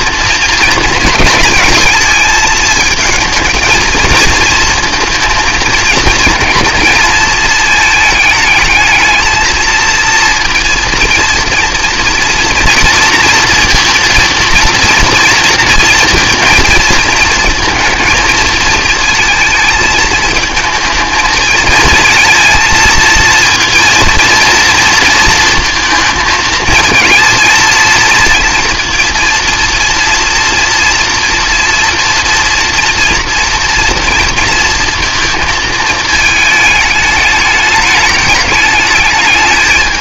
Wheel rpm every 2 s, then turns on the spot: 220, 220, 220, 230, 220, 230, 230, 230, 230, 220, 220, 230, 230, 220, 230, 240, 230, 230, 210, 210.
none